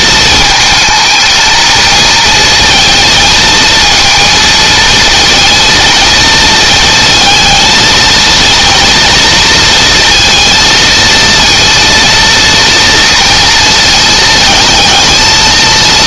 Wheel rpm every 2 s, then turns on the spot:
220, 230, 220, 220, 230, 230, 230, 220.
none